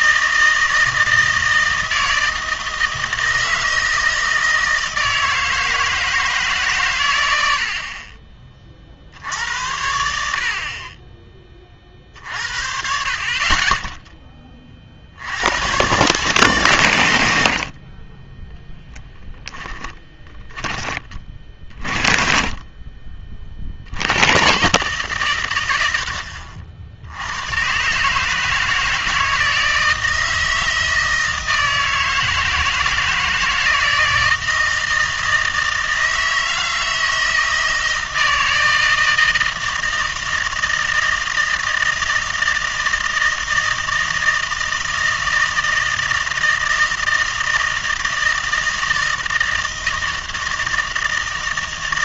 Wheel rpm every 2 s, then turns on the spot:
160, 160, 160, 140, 30, 50, 50, 40, 130, 10, 20, 30, 120, 60, 150, 160, 160, 160, 160, 160, 160, 160, 160, 160, 160, 160.
20-22